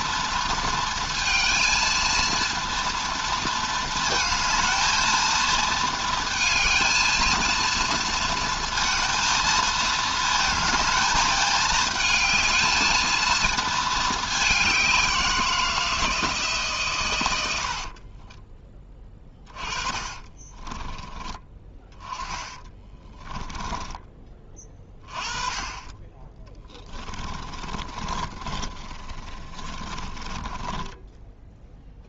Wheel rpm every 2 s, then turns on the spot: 230, 230, 220, 220, 230, 220, 220, 190, 130, 20, 20, 20, 20, 10, 30, 10.
18-24 26-32